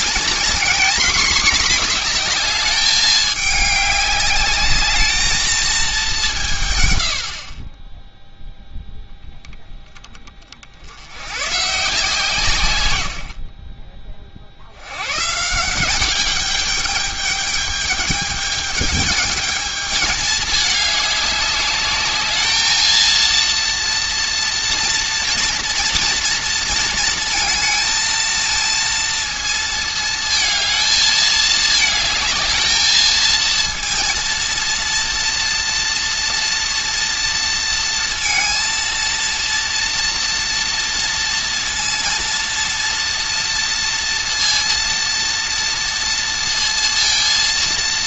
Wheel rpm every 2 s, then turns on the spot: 230, 210, 210, 120, 0, 80, 110, 90, 200, 210, 210, 220, 230, 220, 230, 220, 220, 230, 230, 230, 240, 230, 230, 230.
none